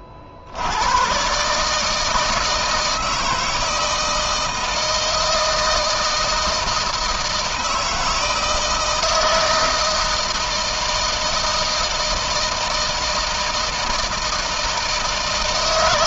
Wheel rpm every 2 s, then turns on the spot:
120, 160, 160, 160, 160, 160, 160, 160.
none